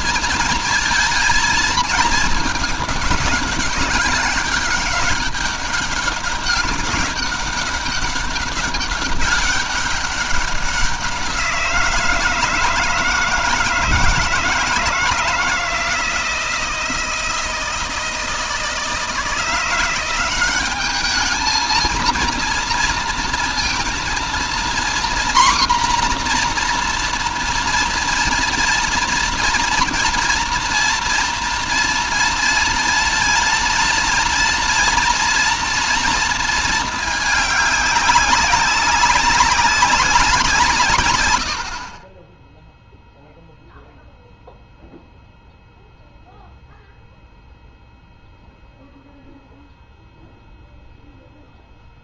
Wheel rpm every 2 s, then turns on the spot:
230, 210, 200, 200, 200, 190, 160, 160, 160, 160, 190, 230, 240, 240, 230, 230, 230, 230, 220, 200, 150, 10, 0, 0, 0, 0.
none